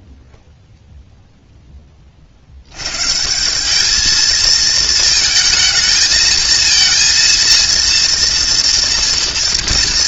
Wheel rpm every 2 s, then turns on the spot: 0, 150, 220, 230, 230.
none